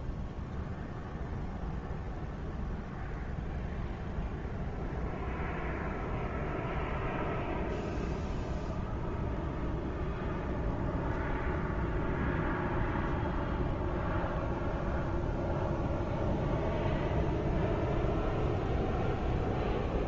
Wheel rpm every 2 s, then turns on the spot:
0, 0, 0, 0, 0, 0, 0, 0, 0, 0.
none